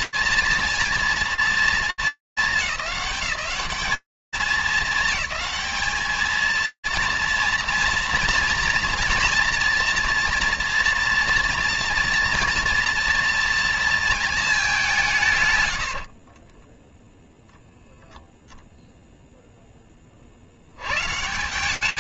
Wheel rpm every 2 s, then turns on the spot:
230, 210, 210, 230, 230, 230, 230, 70, 0, 60, 180.
14-16